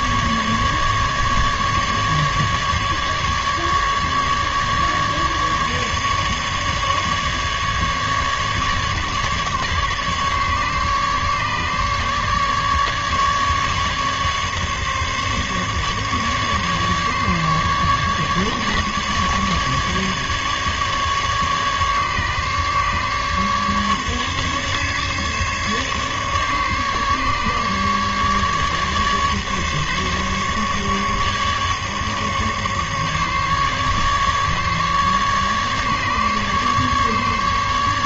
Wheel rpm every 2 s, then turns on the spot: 150, 150, 140, 150, 140, 150, 150, 140, 150, 150, 150, 140, 150, 140, 150, 150, 150, 150, 150.
none